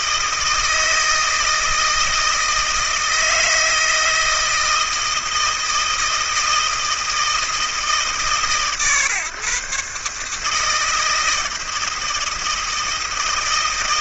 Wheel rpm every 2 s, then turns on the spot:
160, 160, 160, 160, 140, 160, 160.
none